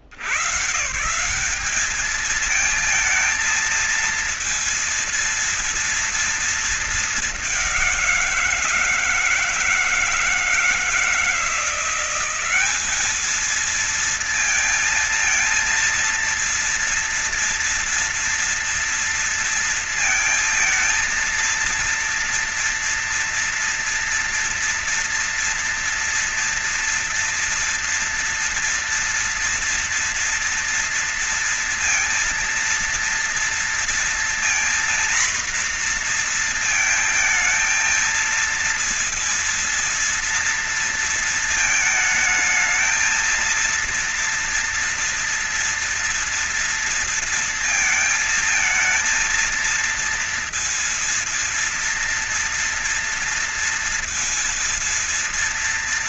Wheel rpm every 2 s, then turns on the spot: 50, 210, 230, 230, 180, 160, 180, 230, 230, 230, 220, 230, 230, 230, 230, 230, 230, 230, 230, 220, 230, 220, 230, 230, 230, 230, 230, 230.
none